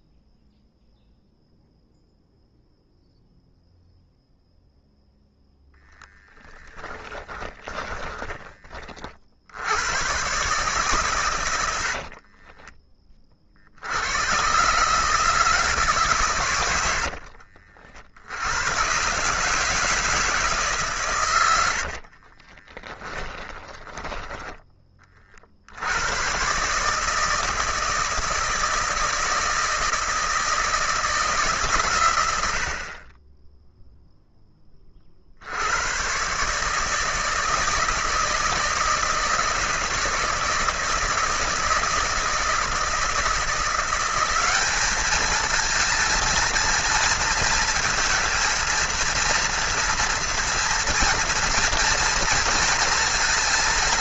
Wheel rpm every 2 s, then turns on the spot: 0, 0, 0, 30, 50, 130, 20, 140, 80, 120, 140, 30, 20, 140, 160, 160, 90, 30, 150, 160, 160, 160, 200, 230, 230, 230, 230.
6-8 16-18 22-24